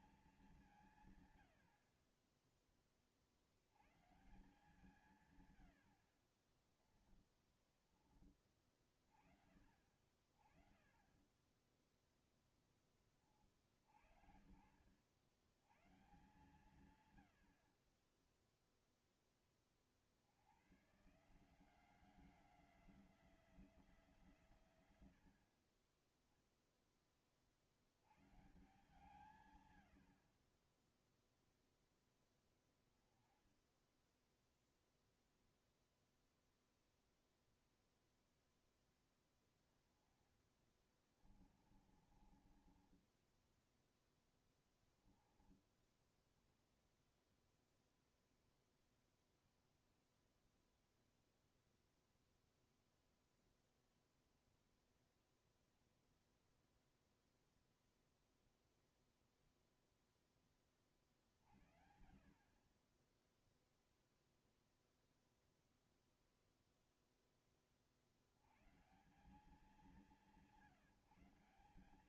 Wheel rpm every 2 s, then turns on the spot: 190, 30, 140, 30, 20, 40, 0, 60, 130, 10, 90, 180, 140, 10, 130, 40, 10, 0, 0, 0, 20, 30, 10, 10, 0, 0, 0, 0, 0, 0, 20, 40, 0, 0, 110, 170.
6-8 10-12 40-46